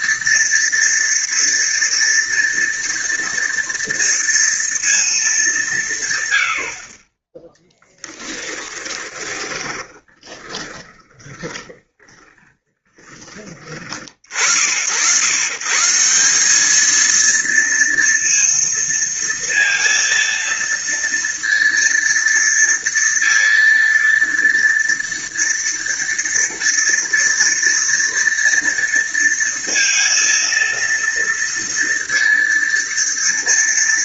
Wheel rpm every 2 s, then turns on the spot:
230, 230, 230, 80, 20, 20, 20, 60, 210, 230, 230, 230, 230, 230, 230, 230, 230.
8-14